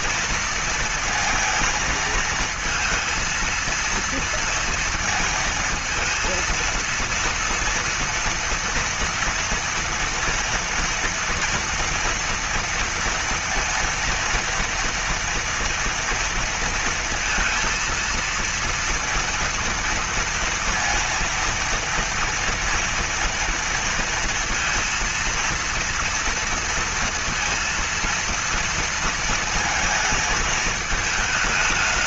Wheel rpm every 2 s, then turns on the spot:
230, 230, 230, 230, 230, 230, 230, 230, 230, 230, 230, 230, 230, 230, 230, 220.
none